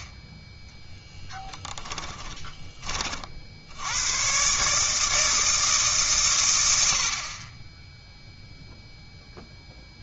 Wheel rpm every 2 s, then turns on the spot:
10, 20, 140, 100, 0.
none